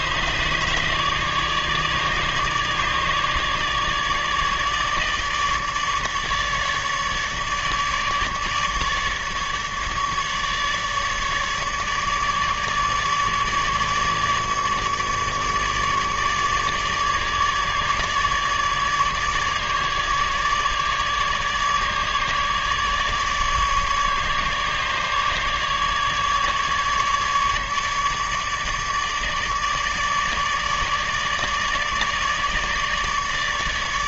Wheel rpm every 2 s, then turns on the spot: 150, 150, 150, 150, 150, 150, 150, 150, 150, 150, 150, 150, 150, 150, 150, 150, 150.
none